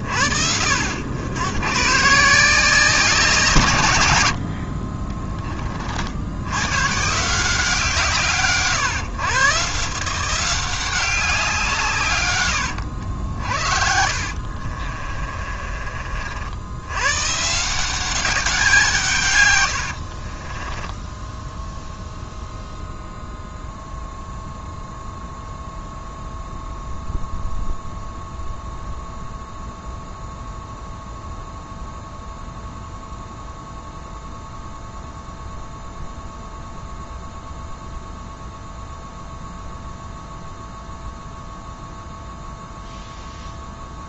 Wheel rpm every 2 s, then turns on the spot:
70, 180, 60, 120, 130, 180, 100, 50, 90, 180, 20, 0, 0, 0, 0, 0, 0, 0, 0, 0, 0, 0.
12-16 20-22